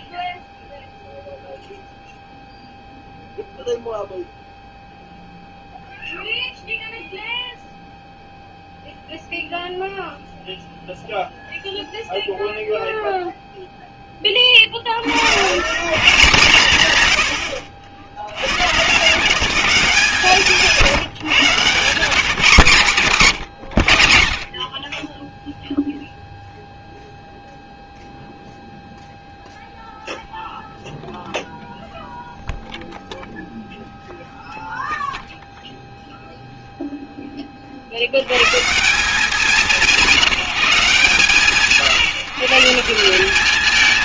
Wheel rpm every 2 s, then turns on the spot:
0, 0, 0, 0, 0, 0, 0, 30, 150, 120, 170, 160, 30, 0, 0, 0, 0, 0, 0, 140, 160, 160.
none